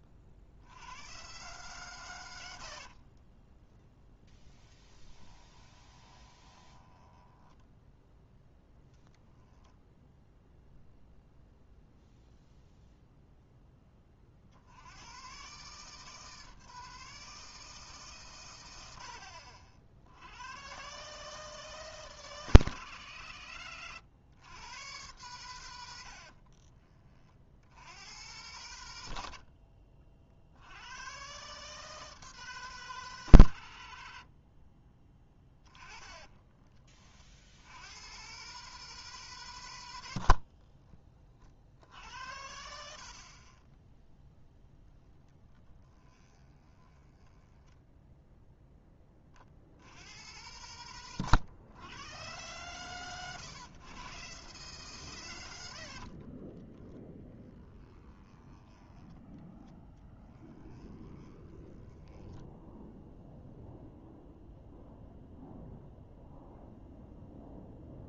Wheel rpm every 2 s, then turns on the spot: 70, 60, 10, 20, 0, 0, 0, 70, 160, 120, 110, 160, 110, 40, 110, 80, 160, 50, 30, 140, 50, 70, 10, 20, 10, 110, 110, 120, 10, 10, 20, 10, 0, 0.
4-8 26-28 44-48 60-64